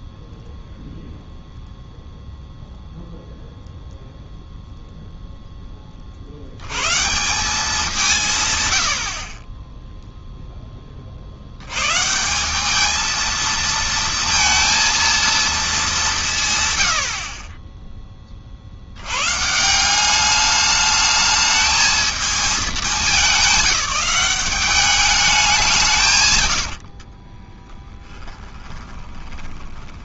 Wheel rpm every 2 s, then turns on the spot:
0, 0, 0, 110, 110, 20, 210, 230, 110, 70, 210, 210, 200, 70, 20.
26-30